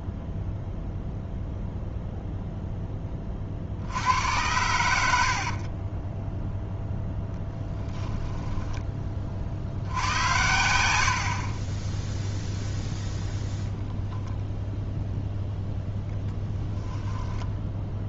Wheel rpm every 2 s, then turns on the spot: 0, 0, 80, 0, 20, 90, 0, 0, 0.
none